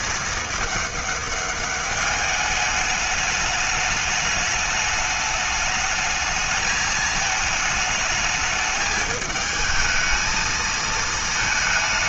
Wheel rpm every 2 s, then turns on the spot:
210, 210, 210, 220, 220, 220.
none